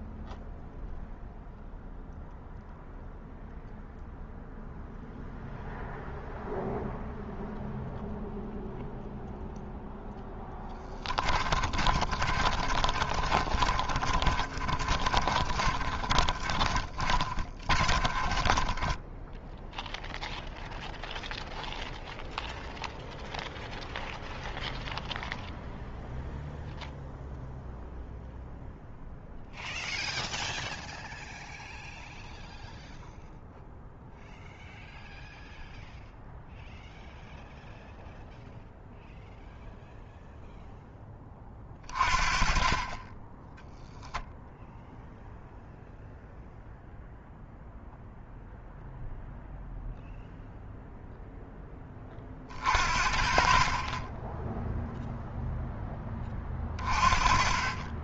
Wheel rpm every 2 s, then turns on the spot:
0, 0, 0, 0, 0, 10, 40, 40, 30, 20, 0, 0, 0, 0, 0, 0, 0, 0, 0, 0, 0, 30, 0, 0, 0, 0, 40, 0, 30.
10-20